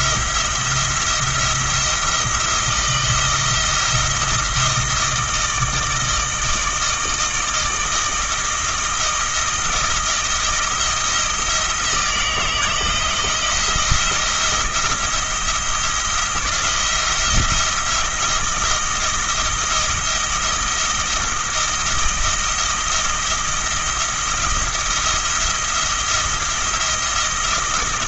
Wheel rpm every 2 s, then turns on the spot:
170, 170, 160, 160, 160, 170, 170, 170, 170, 170, 170, 160, 170, 170.
none